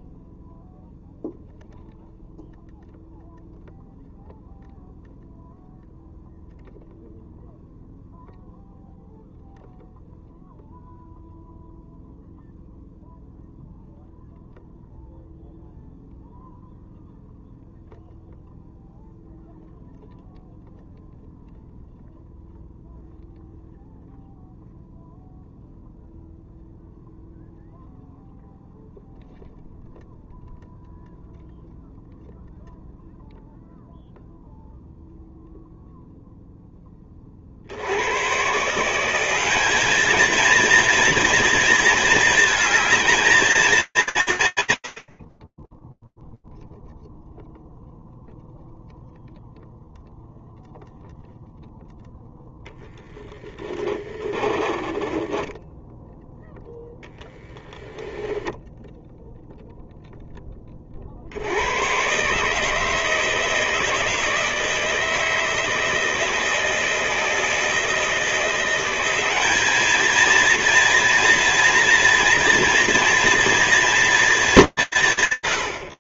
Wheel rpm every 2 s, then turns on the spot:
0, 0, 0, 0, 0, 0, 0, 0, 0, 0, 0, 0, 0, 0, 0, 0, 0, 0, 0, 140, 230, 220, 150, 0, 0, 0, 10, 20, 10, 0, 50, 150, 160, 160, 190, 230, 240, 160.
52-58